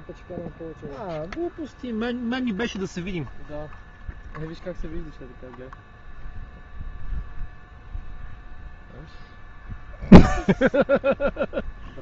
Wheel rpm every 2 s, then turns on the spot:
0, 0, 0, 0, 0, 0.
none